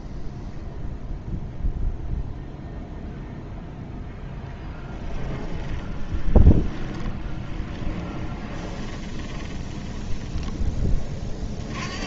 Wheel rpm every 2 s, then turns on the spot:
0, 0, 10, 20, 20, 30.
4-10